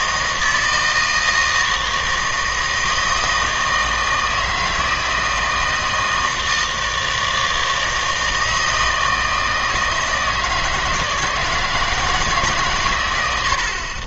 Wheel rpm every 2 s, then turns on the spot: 160, 160, 160, 160, 160, 150, 130.
none